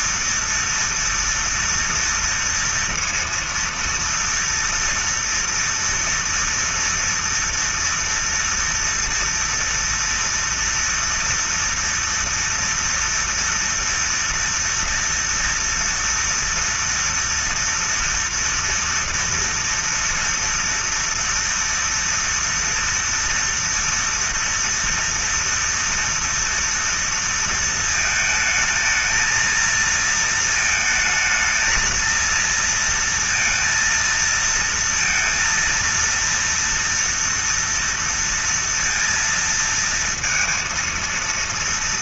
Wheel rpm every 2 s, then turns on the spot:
230, 230, 230, 230, 230, 230, 240, 230, 230, 230, 230, 240, 240, 230, 220, 230, 230, 230, 230, 230, 230.
none